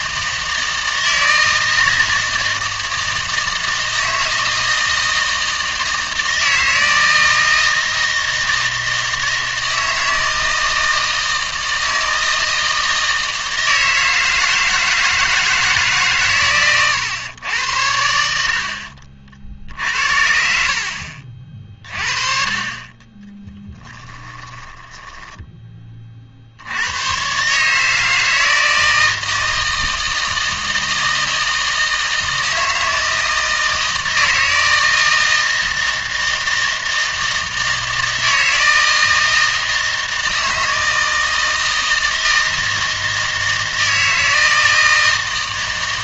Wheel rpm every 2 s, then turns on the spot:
160, 160, 160, 160, 160, 160, 160, 160, 110, 60, 50, 30, 20, 70, 160, 160, 160, 160, 160, 160, 160, 160, 160.
24-26